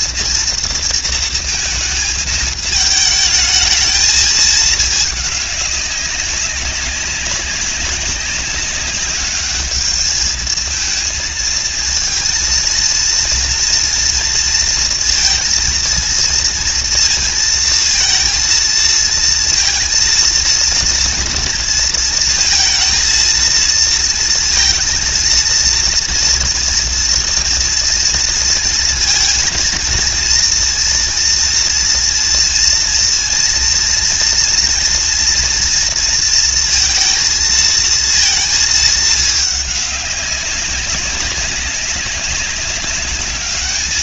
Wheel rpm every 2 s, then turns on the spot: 230, 220, 210, 200, 200, 230, 230, 230, 230, 230, 230, 230, 230, 230, 230, 230, 230, 230, 230, 210, 200, 210.
none